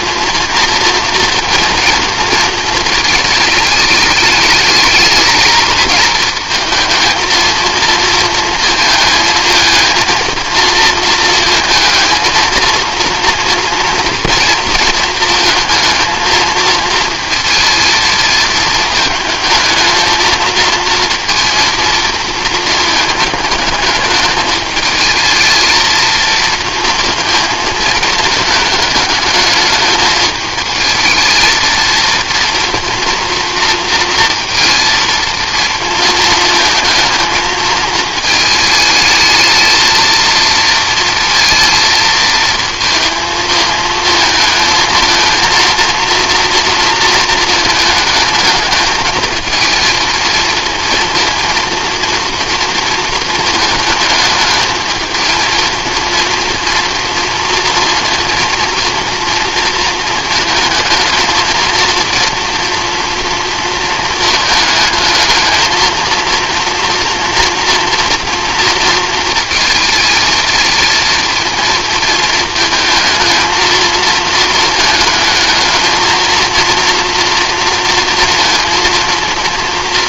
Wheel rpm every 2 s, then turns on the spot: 230, 220, 210, 230, 220, 230, 230, 230, 230, 220, 230, 220, 220, 220, 210, 220, 230, 230, 220, 220, 230, 230, 220, 230, 220, 230, 230, 220, 230, 230, 220, 230, 220, 230, 230, 230, 220, 220, 230, 230.
none